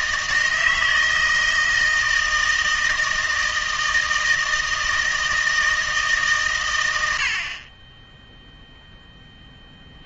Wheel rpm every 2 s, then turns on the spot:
160, 160, 160, 110, 0.
none